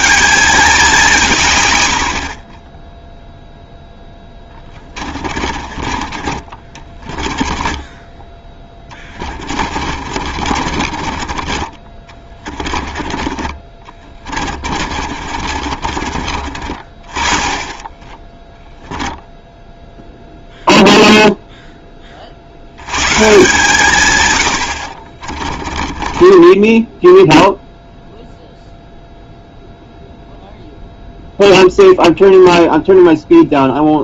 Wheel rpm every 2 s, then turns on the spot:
210, 30, 20, 30, 10, 40, 30, 30, 40, 10, 0, 90, 80, 10, 0, 0, 0.
2-16 26-28